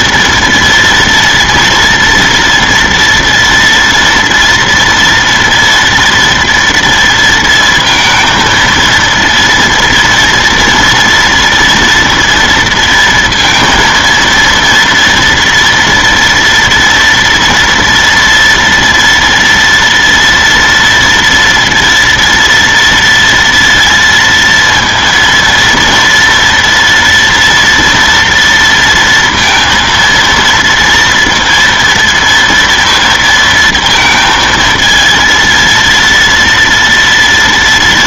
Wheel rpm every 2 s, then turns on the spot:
230, 230, 230, 230, 230, 230, 230, 230, 230, 240, 230, 230, 230, 230, 230, 230, 230, 230, 230.
none